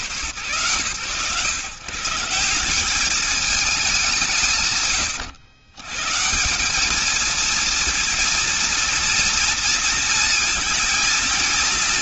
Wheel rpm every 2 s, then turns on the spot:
130, 170, 180, 150, 230, 230.
none